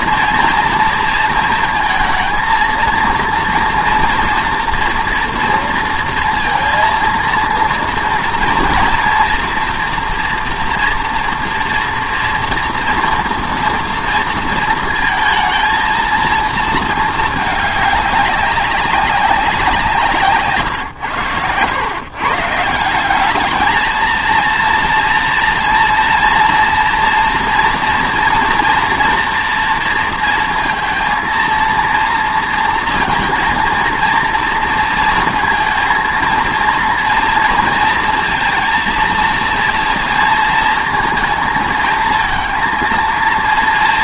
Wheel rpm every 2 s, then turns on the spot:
230, 230, 240, 230, 230, 230, 230, 230, 220, 200, 150, 160, 230, 230, 230, 230, 230, 230, 230, 230, 230, 230.
none